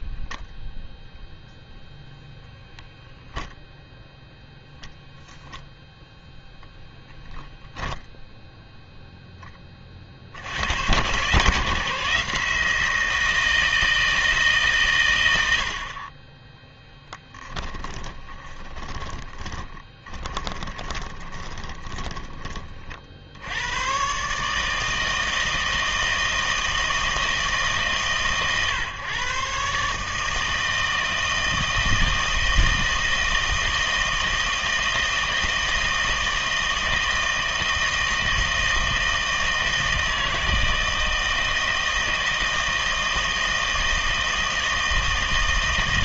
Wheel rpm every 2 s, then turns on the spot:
0, 0, 10, 0, 0, 90, 170, 140, 10, 20, 20, 20, 150, 160, 130, 160, 160, 160, 160, 160, 160, 160, 160.
18-22